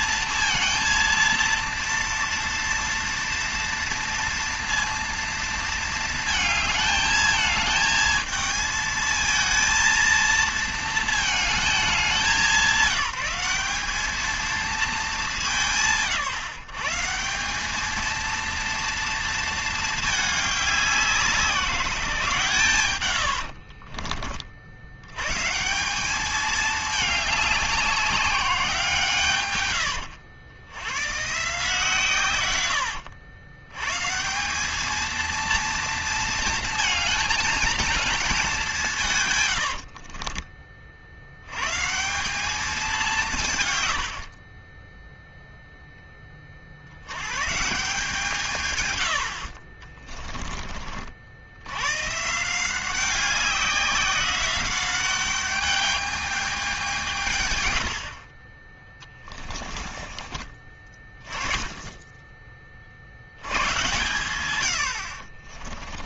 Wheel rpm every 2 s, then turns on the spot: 230, 230, 230, 220, 220, 220, 190, 220, 170, 230, 210, 130, 60, 210, 180, 80, 110, 190, 230, 200, 40, 200, 40, 60, 140, 30, 160, 190, 200, 30, 30, 30, 100.
40-42